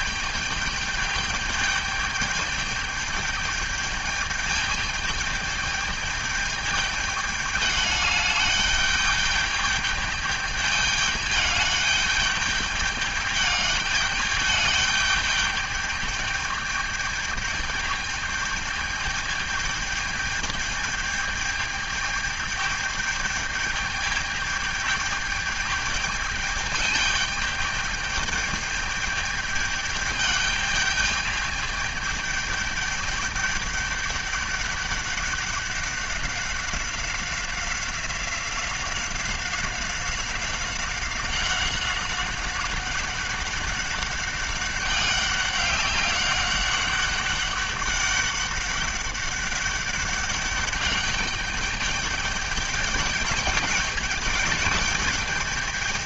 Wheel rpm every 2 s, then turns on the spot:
210, 210, 210, 210, 210, 210, 210, 210, 210, 210, 210, 210, 210, 210, 210, 210, 210, 200, 190, 190, 190, 190, 200, 200, 200, 200, 200, 210.
none